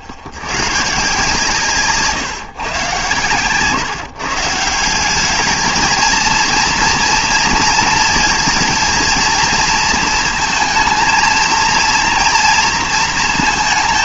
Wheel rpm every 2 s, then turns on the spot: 100, 130, 160, 230, 220, 230, 230.
none